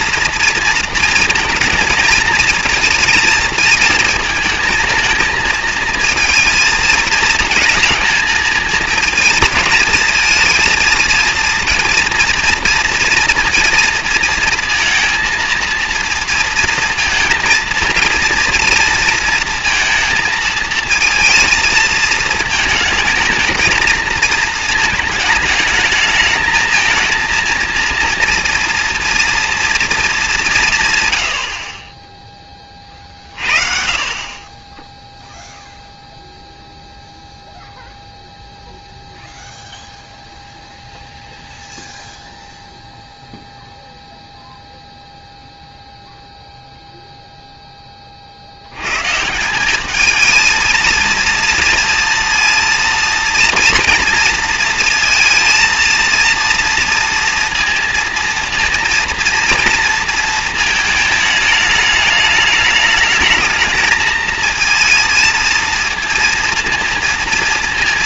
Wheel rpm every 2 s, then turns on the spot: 230, 220, 230, 220, 230, 230, 230, 230, 230, 230, 230, 220, 220, 220, 230, 140, 30, 10, 0, 0, 0, 0, 0, 0, 110, 220, 230, 230, 230, 230, 220, 210, 230, 230.
none